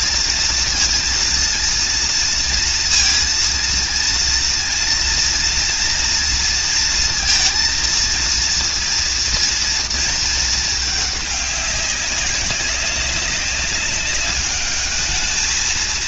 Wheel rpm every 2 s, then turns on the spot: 230, 230, 230, 230, 230, 220, 190, 210.
none